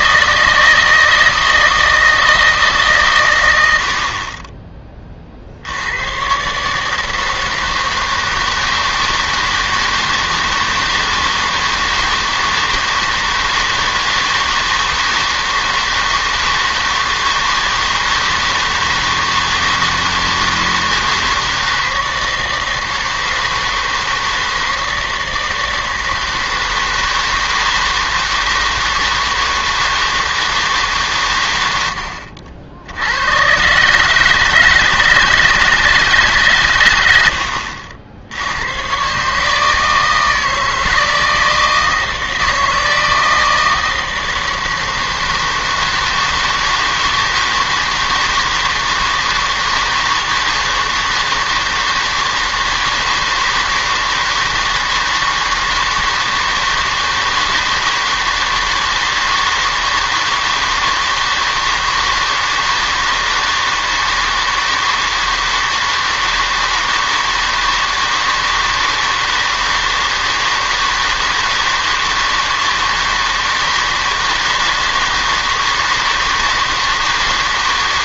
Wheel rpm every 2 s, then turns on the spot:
160, 150, 20, 150, 160, 160, 160, 160, 160, 160, 160, 160, 160, 160, 160, 160, 70, 160, 140, 90, 160, 160, 160, 160, 160, 160, 160, 160, 160, 160, 160, 160, 160, 160, 160, 160, 160, 160, 160.
none